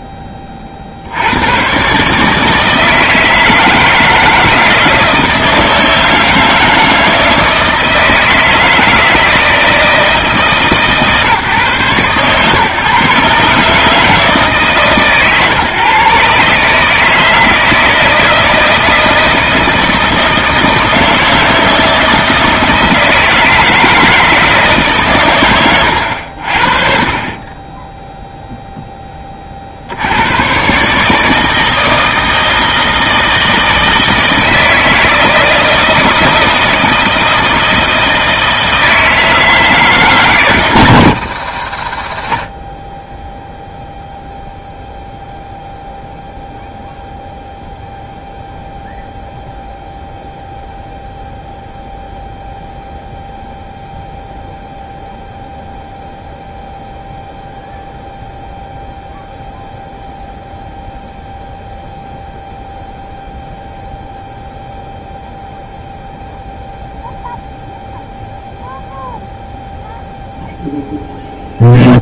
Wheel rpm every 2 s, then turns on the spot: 40, 160, 160, 160, 160, 140, 140, 150, 140, 160, 160, 160, 150, 40, 0, 140, 160, 160, 160, 160, 130, 20, 0, 0, 0, 0, 0, 0, 0, 0, 0, 0, 0, 0, 0, 0.
none